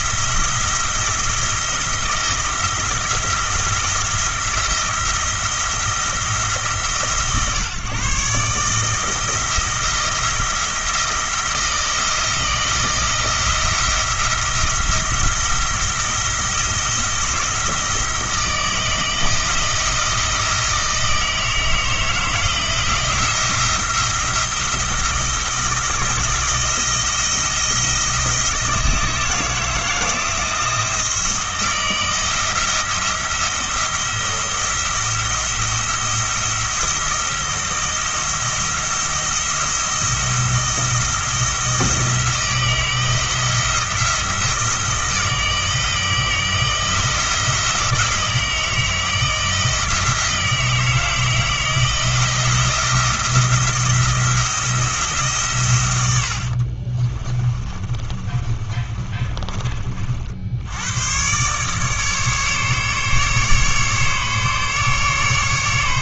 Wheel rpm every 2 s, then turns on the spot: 170, 170, 170, 160, 140, 170, 160, 170, 170, 160, 160, 160, 170, 170, 170, 160, 170, 170, 170, 170, 160, 160, 160, 160, 160, 160, 170, 170, 60, 30, 70, 150, 140.
56-60